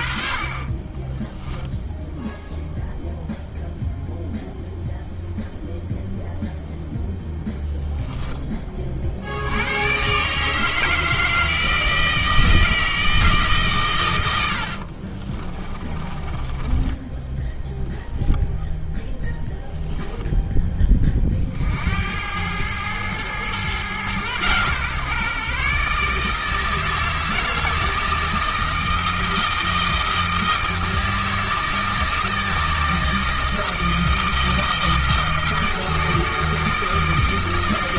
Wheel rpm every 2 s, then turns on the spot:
20, 0, 0, 0, 40, 160, 160, 50, 10, 0, 20, 110, 130, 160, 160, 160, 160, 160, 160.
14-18